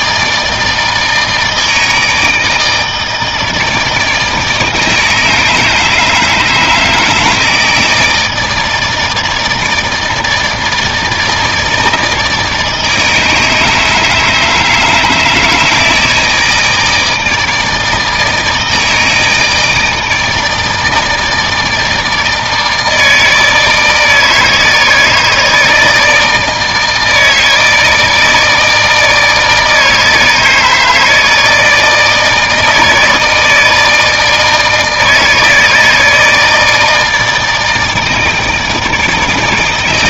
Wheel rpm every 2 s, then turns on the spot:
160, 160, 160, 160, 160, 160, 160, 150, 160, 160, 160, 160, 160, 160, 160, 160, 160, 160, 160, 160.
none